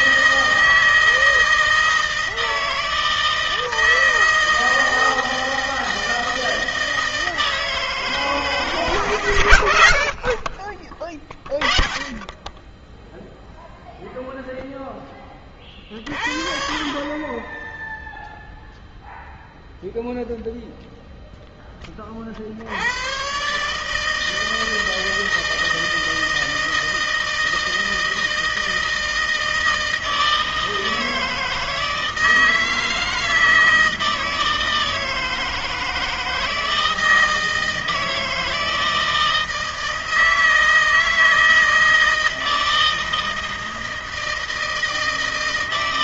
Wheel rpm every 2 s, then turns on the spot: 160, 160, 160, 160, 160, 50, 20, 0, 30, 0, 0, 60, 160, 160, 160, 160, 160, 160, 160, 160, 160, 160, 160.
none